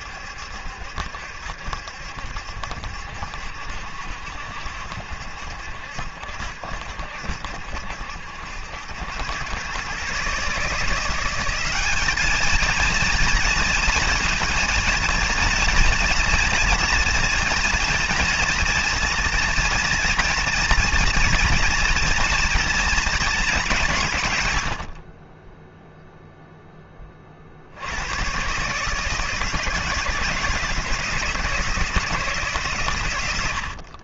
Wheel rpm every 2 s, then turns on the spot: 70, 70, 70, 70, 90, 170, 230, 230, 240, 230, 240, 220, 100, 10, 130, 160, 130.
24-26